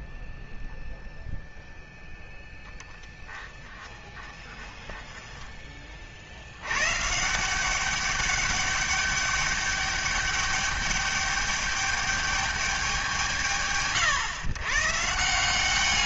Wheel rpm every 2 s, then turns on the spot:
0, 10, 20, 90, 200, 200, 200, 130.
none